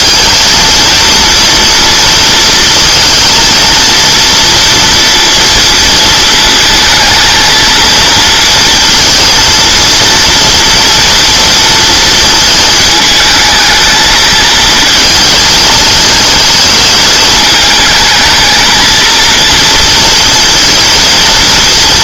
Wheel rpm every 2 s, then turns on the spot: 230, 230, 230, 220, 220, 230, 220, 220, 220, 220, 230.
none